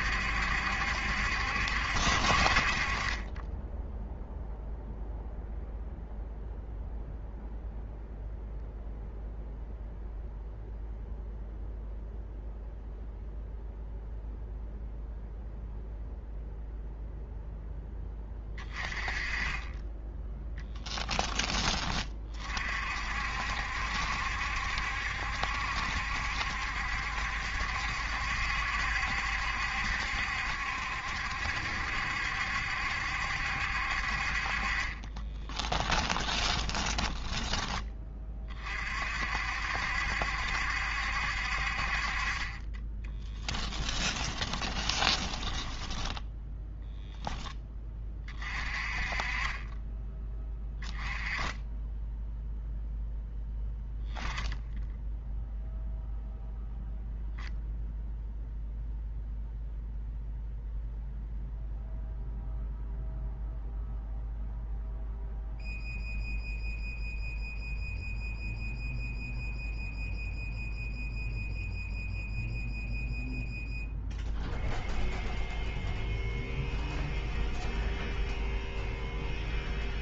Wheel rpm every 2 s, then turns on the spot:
70, 50, 0, 0, 0, 0, 0, 0, 0, 20, 10, 50, 70, 70, 70, 70, 70, 40, 20, 40, 70, 20, 20, 0, 30, 10, 0, 10, 0, 0, 0, 0, 0, 0, 0, 0, 0, 0, 0, 0.
36-38 44-46